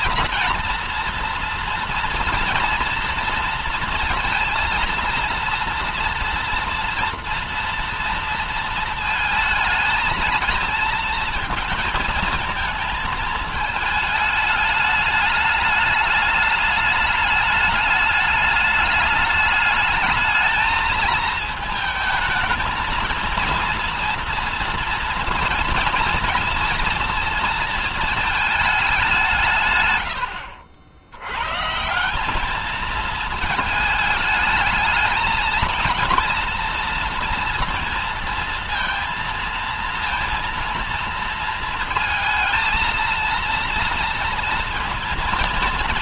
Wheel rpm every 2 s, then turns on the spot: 230, 230, 230, 240, 230, 230, 220, 210, 210, 210, 220, 230, 230, 230, 220, 80, 210, 220, 230, 230, 230, 220, 230.
none